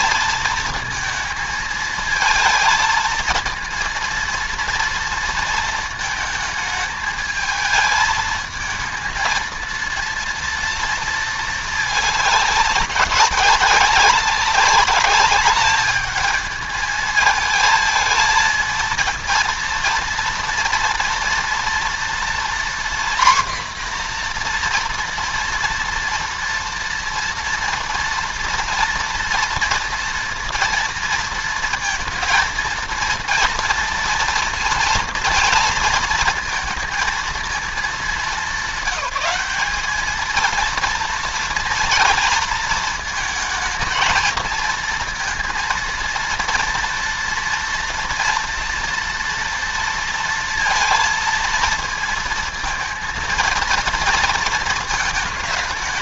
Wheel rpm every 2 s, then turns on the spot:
220, 230, 230, 220, 220, 230, 190, 200, 220, 230, 230, 250, 240, 230, 230, 230, 230, 230, 230, 190, 230, 230, 230, 230, 230, 230, 230, 230.
none